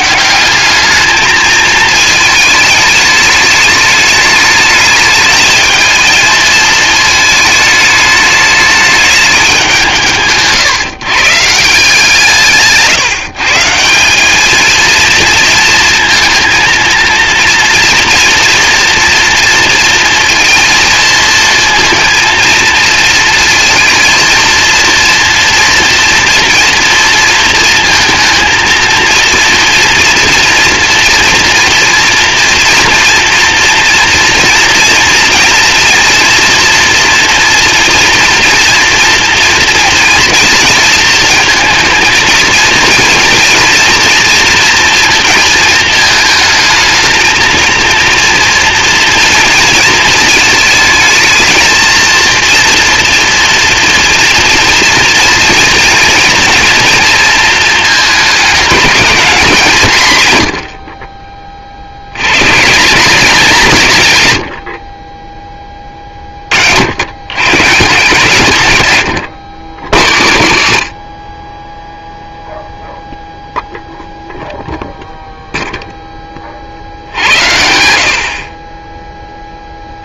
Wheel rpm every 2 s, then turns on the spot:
210, 210, 210, 220, 210, 140, 150, 220, 230, 230, 230, 230, 230, 230, 230, 230, 230, 230, 230, 230, 230, 230, 230, 220, 230, 230, 230, 230, 230, 210, 60, 140, 50, 60, 130, 100, 0, 0, 60, 30.
none